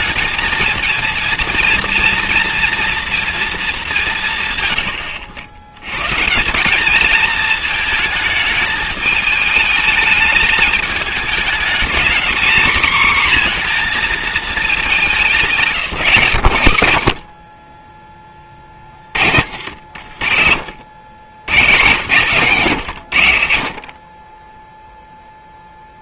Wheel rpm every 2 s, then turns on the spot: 220, 230, 130, 190, 220, 210, 240, 210, 100, 40, 80, 160, 10.
20-24